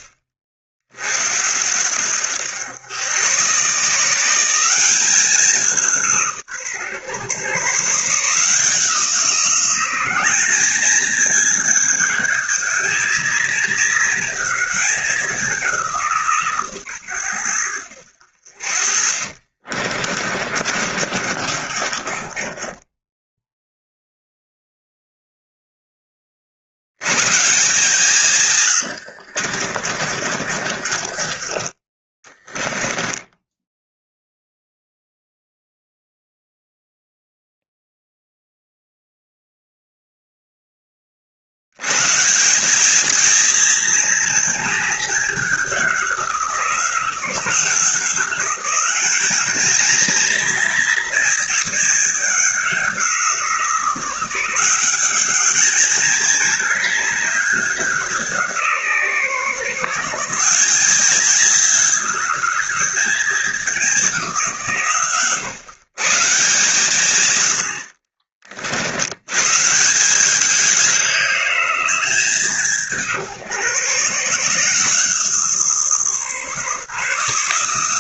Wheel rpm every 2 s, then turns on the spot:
60, 90, 180, 130, 160, 210, 220, 210, 130, 50, 40, 20, 0, 70, 110, 40, 20, 0, 0, 0, 20, 200, 220, 180, 190, 230, 190, 190, 210, 150, 190, 200, 150, 150, 70, 190, 170, 150, 140.
18-24 28-34